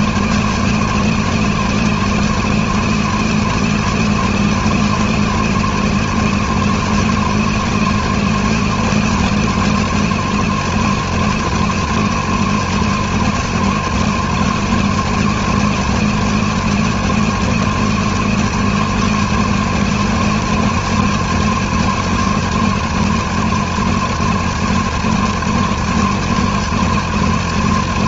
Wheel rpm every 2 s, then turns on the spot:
230, 230, 230, 230, 230, 230, 230, 230, 230, 230, 230, 230, 220, 230.
none